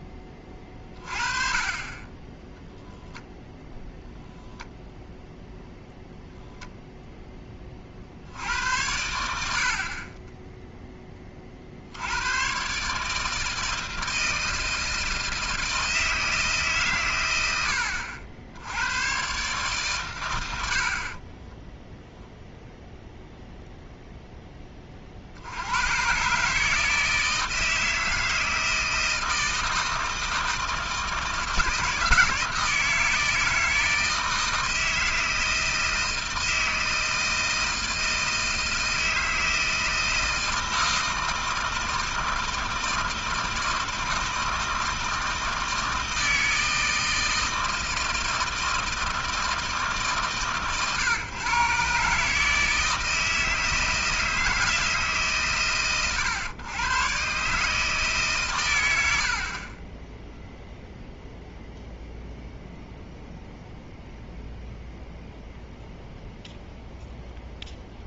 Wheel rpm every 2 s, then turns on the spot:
20, 10, 0, 0, 80, 10, 120, 160, 150, 80, 90, 0, 10, 140, 160, 160, 160, 160, 160, 160, 160, 160, 160, 160, 160, 140, 160, 160, 120, 140, 0, 0, 0, 0.
none